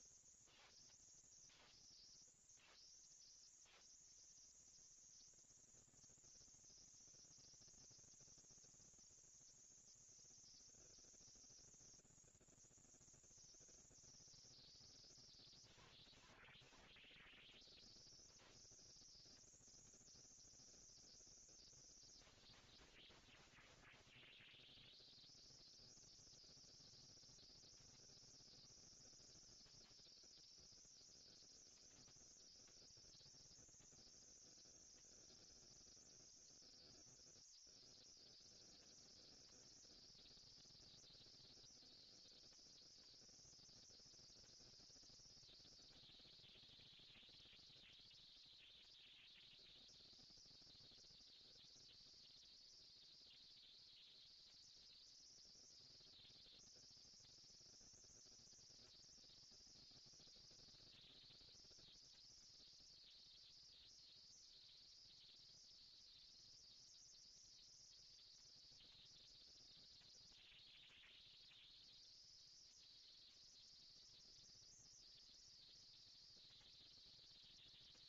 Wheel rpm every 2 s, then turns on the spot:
220, 220, 230, 230, 230, 230, 230, 240, 230, 230, 230, 190, 20, 110, 90, 130, 210, 230, 230, 230, 230, 230, 230, 220, 230, 230, 230, 230, 230, 230, 230, 230, 230, 230, 230, 220, 200, 190, 190.
24-26